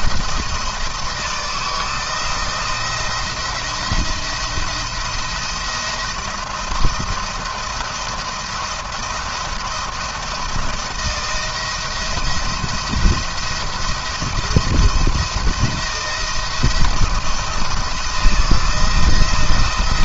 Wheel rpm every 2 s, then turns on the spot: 160, 170, 170, 160, 170, 170, 170, 170, 170, 170.
none